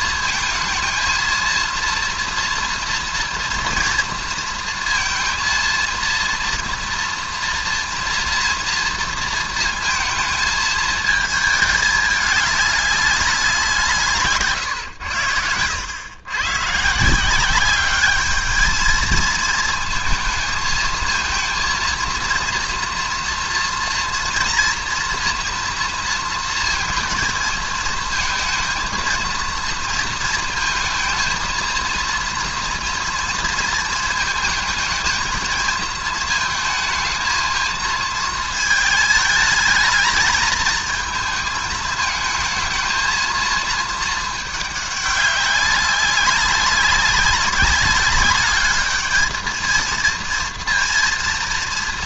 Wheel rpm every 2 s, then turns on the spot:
220, 230, 230, 230, 230, 220, 200, 130, 120, 220, 220, 230, 240, 230, 230, 230, 230, 220, 220, 220, 220, 220, 210, 190, 210, 230.
none